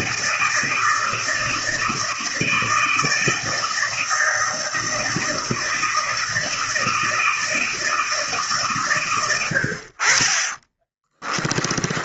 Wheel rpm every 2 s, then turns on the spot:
160, 160, 160, 160, 150, 30.
10-12